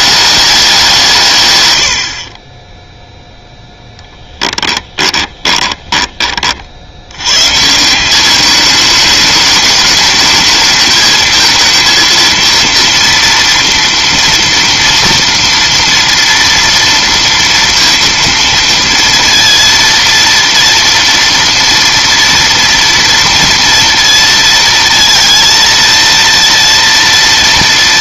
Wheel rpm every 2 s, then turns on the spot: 200, 20, 10, 50, 210, 220, 230, 230, 230, 230, 230, 230, 220, 230.
4-6